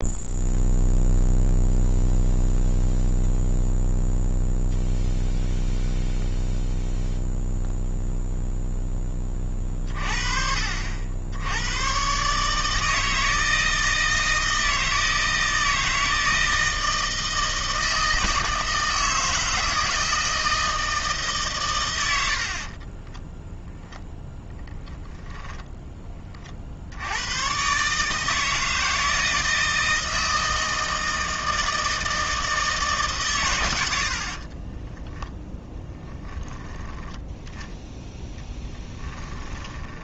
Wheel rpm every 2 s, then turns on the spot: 0, 0, 0, 0, 10, 60, 160, 160, 160, 160, 160, 30, 0, 70, 160, 160, 160, 20, 10, 10.
22-24 34-36 38-40